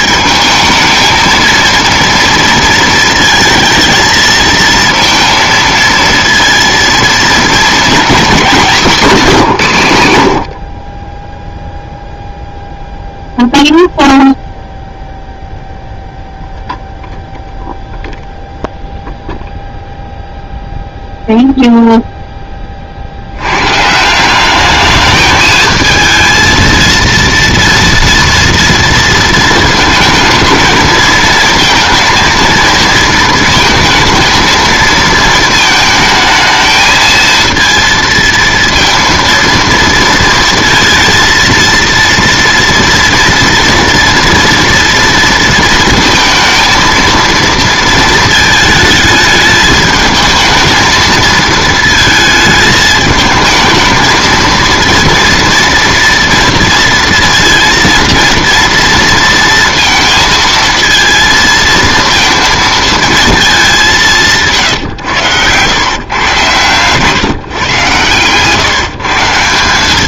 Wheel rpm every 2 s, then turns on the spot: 220, 230, 230, 230, 230, 60, 0, 0, 0, 0, 0, 20, 200, 220, 230, 220, 230, 220, 220, 230, 230, 230, 230, 230, 220, 220, 220, 230, 230, 230, 220, 230, 140, 130, 140.
none